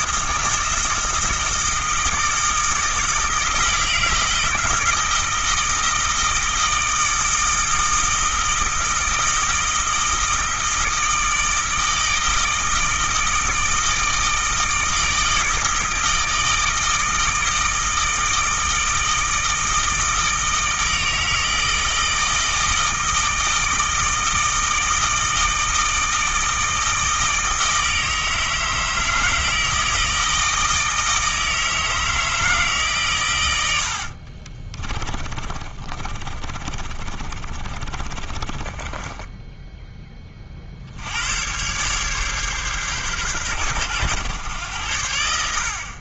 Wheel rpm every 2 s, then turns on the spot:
160, 160, 160, 160, 160, 160, 160, 160, 160, 160, 160, 160, 160, 160, 160, 160, 140, 20, 30, 20, 70, 140, 90.
34-40